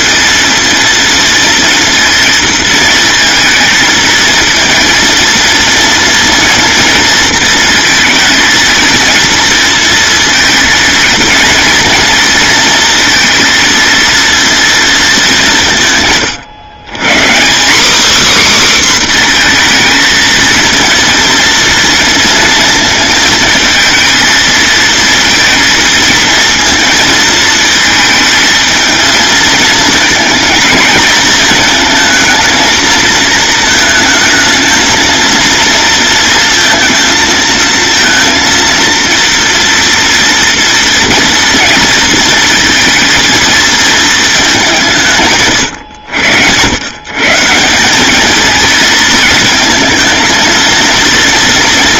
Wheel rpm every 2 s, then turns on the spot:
230, 230, 230, 230, 220, 230, 230, 220, 150, 270, 230, 230, 230, 230, 220, 220, 230, 220, 230, 230, 230, 230, 170, 110, 220, 230.
none